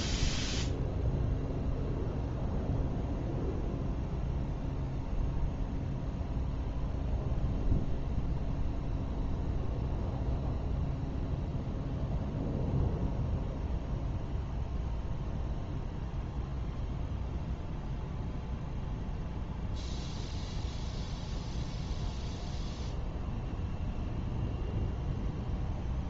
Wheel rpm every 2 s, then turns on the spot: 0, 0, 0, 0, 0, 0, 0, 0, 0, 0, 0, 0, 0.
none